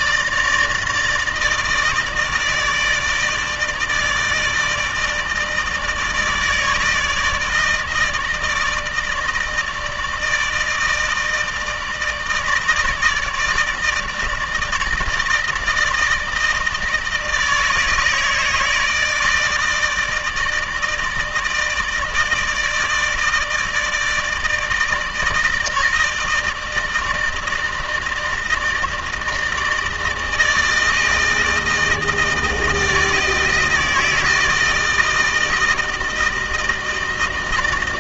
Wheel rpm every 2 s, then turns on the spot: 160, 160, 160, 160, 160, 160, 150, 160, 160, 160, 160, 160, 160, 160, 160, 160, 160, 160, 160.
none